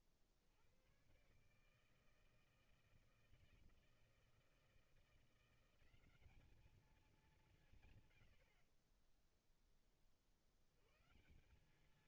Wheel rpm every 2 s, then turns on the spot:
70, 160, 160, 200, 90, 60.
8-10